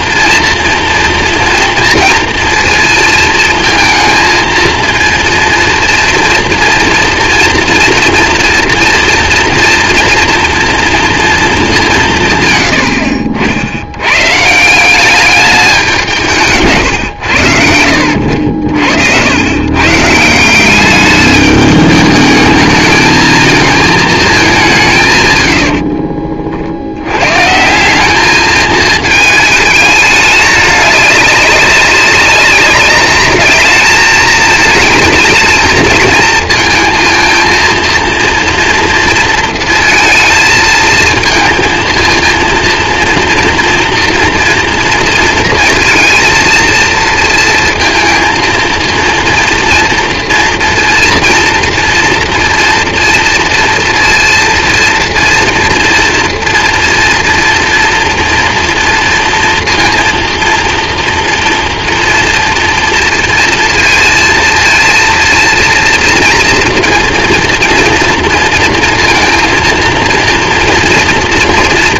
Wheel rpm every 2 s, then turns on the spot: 230, 230, 230, 230, 230, 230, 110, 160, 160, 70, 180, 210, 190, 50, 220, 210, 200, 220, 230, 230, 230, 230, 240, 230, 230, 230, 230, 230, 230, 230, 240, 230, 230, 230, 230, 230.
16-18